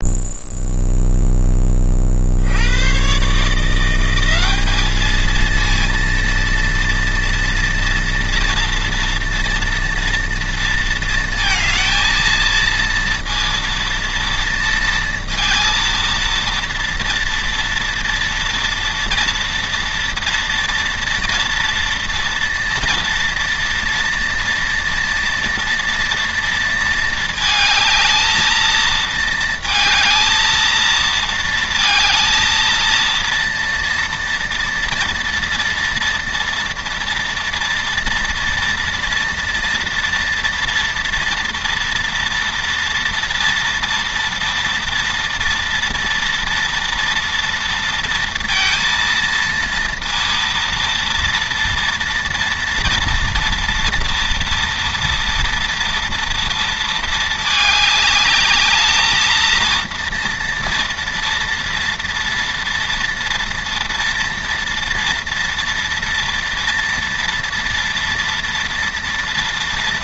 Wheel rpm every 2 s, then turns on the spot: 0, 100, 210, 230, 230, 230, 230, 230, 230, 230, 230, 230, 230, 230, 220, 220, 230, 230, 230, 230, 230, 230, 230, 230, 230, 230, 230, 230, 230, 210, 230, 230, 230, 230, 230.
none